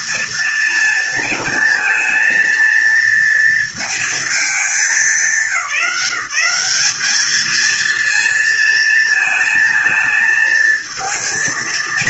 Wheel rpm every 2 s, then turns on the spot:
230, 230, 200, 200, 230, 220.
none